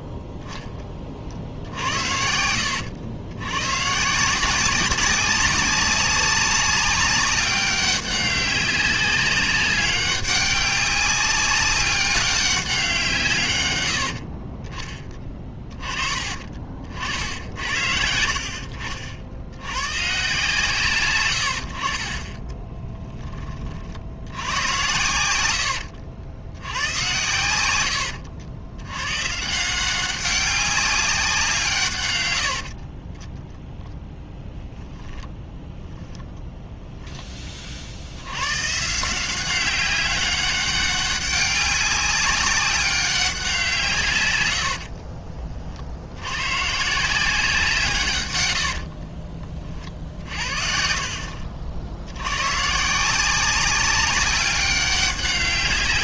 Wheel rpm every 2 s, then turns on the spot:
10, 90, 190, 190, 190, 200, 190, 30, 40, 50, 150, 20, 90, 90, 100, 200, 70, 10, 0, 120, 200, 190, 90, 130, 80, 50, 130, 190.
22-24 32-34 48-50